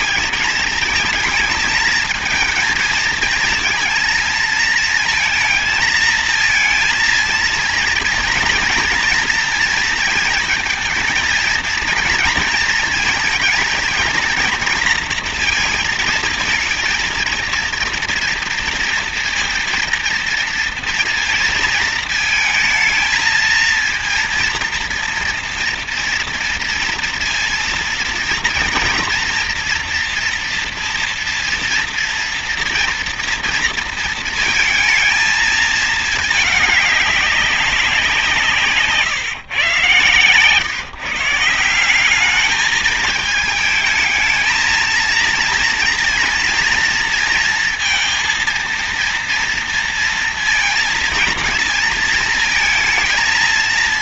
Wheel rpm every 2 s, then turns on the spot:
220, 230, 220, 230, 230, 230, 230, 230, 230, 230, 230, 230, 230, 230, 230, 230, 230, 220, 210, 150, 140, 210, 220, 230, 230, 230, 220.
none